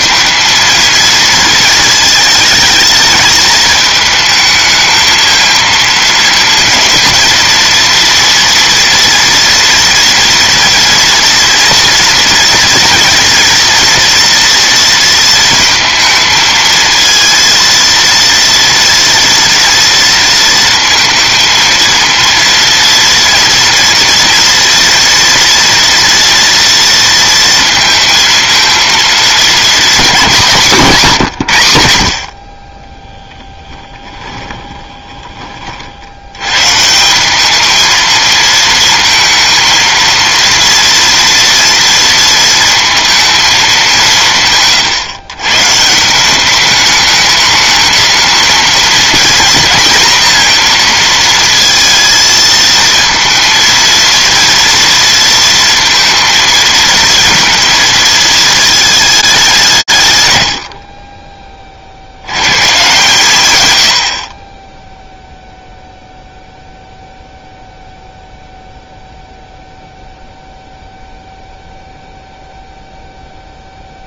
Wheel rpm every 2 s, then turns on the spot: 230, 220, 220, 230, 230, 230, 240, 230, 230, 230, 230, 230, 230, 230, 230, 190, 30, 20, 130, 220, 230, 230, 150, 200, 220, 230, 220, 230, 220, 220, 80, 140, 20, 0, 0, 0, 0.
34-36